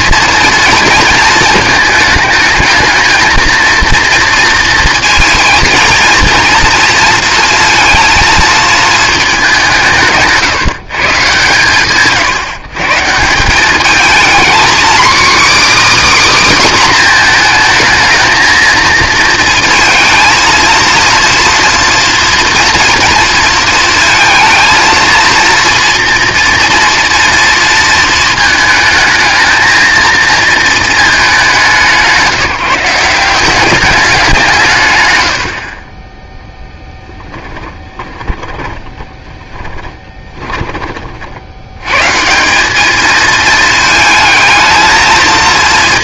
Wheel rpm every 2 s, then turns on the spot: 230, 220, 230, 230, 220, 140, 160, 250, 270, 230, 230, 240, 220, 240, 220, 230, 170, 170, 10, 20, 30, 180, 220.
38-42